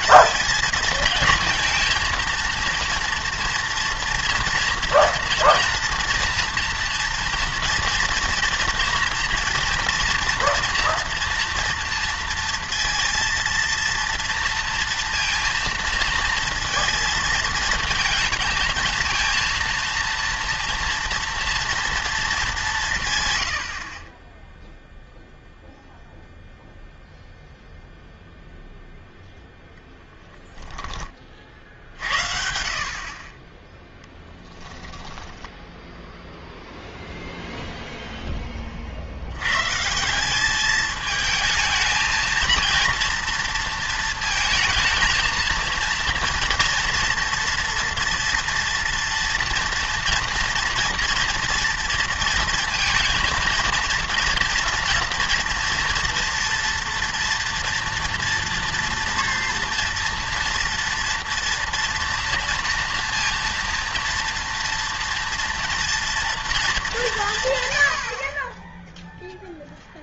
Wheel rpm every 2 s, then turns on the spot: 230, 230, 230, 230, 230, 240, 230, 230, 230, 230, 230, 180, 0, 0, 0, 10, 50, 10, 0, 30, 210, 230, 220, 230, 230, 230, 230, 230, 230, 230, 230, 230, 230, 220, 20.
none